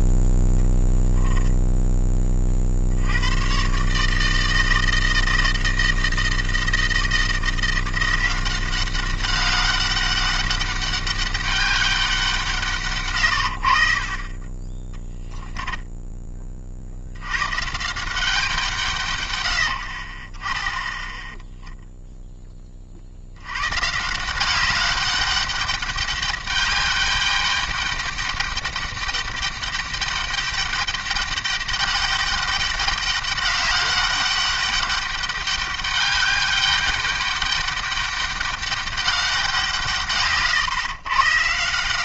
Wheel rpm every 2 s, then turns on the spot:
10, 60, 160, 160, 190, 200, 160, 30, 40, 140, 10, 30, 200, 200, 200, 200, 200, 200, 200, 200, 130.
none